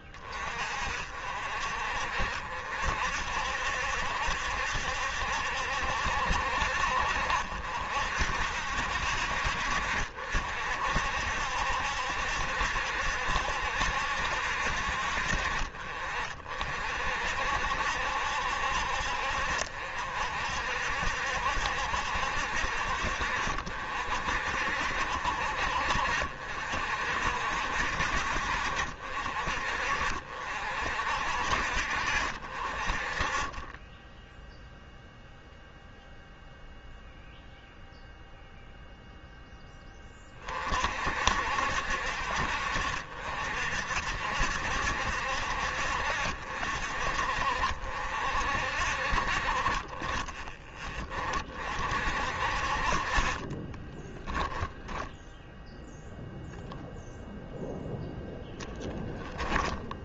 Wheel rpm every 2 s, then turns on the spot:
40, 60, 70, 60, 60, 60, 70, 60, 60, 60, 60, 60, 50, 50, 50, 60, 40, 0, 0, 0, 40, 60, 60, 50, 50, 20, 40, 10, 0, 10.
58-60